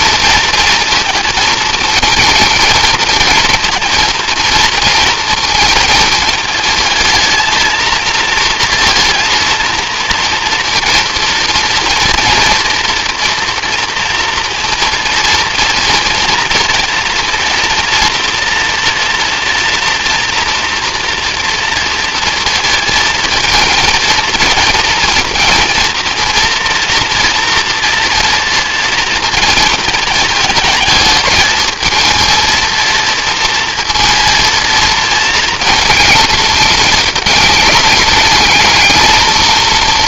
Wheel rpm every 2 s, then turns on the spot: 220, 220, 220, 220, 230, 230, 240, 230, 230, 230, 230, 230, 230, 240, 230, 220, 230, 220, 210, 220.
none